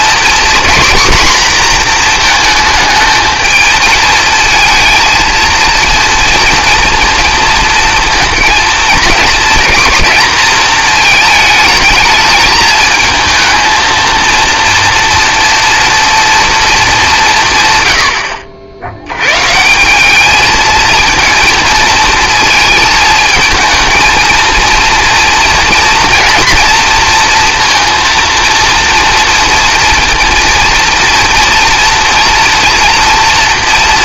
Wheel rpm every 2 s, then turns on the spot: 250, 220, 230, 230, 220, 220, 220, 230, 180, 110, 230, 220, 230, 230, 230, 230, 230.
none